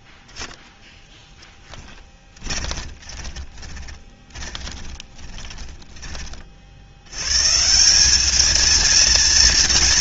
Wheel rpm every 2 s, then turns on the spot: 10, 20, 10, 40, 220.
2-6